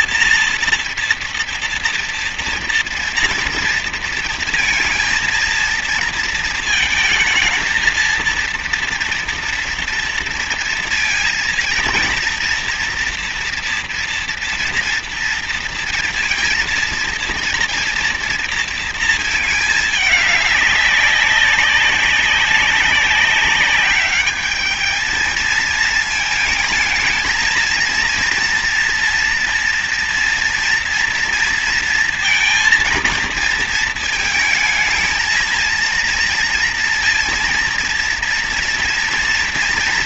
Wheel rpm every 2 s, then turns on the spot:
230, 230, 230, 220, 230, 230, 230, 240, 230, 230, 200, 200, 220, 220, 230, 240, 230, 220, 230, 240.
none